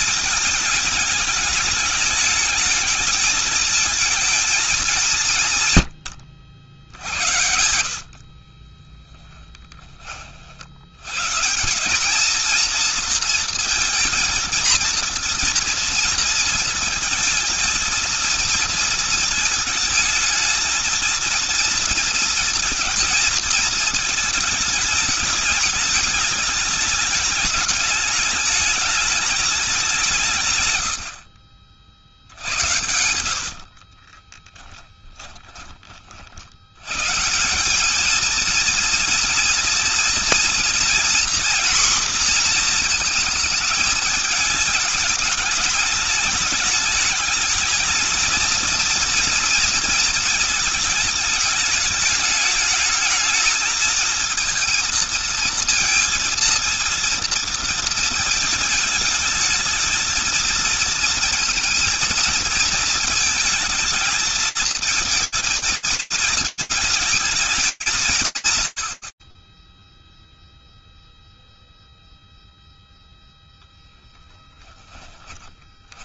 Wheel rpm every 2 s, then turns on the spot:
210, 210, 210, 90, 30, 60, 230, 230, 230, 230, 230, 230, 220, 210, 210, 150, 70, 30, 80, 220, 240, 240, 210, 210, 230, 220, 210, 230, 230, 220, 230, 220, 220, 220, 90, 0, 0, 10.
6-10 30-36 74-76